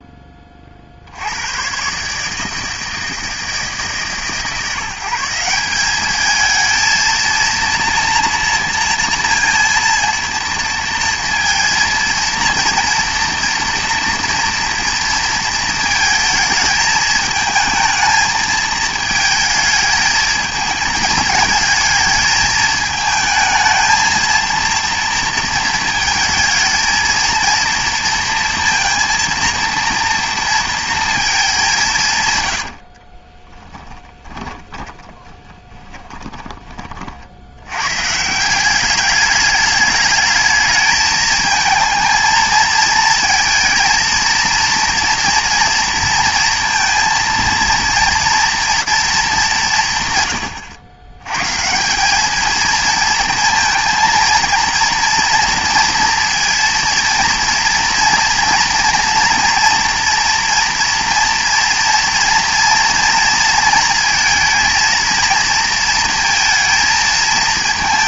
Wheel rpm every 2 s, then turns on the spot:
30, 160, 150, 220, 230, 230, 230, 230, 220, 220, 220, 220, 230, 220, 230, 230, 110, 20, 30, 180, 220, 220, 230, 230, 230, 100, 220, 230, 230, 240, 230, 240, 230, 220.
34-36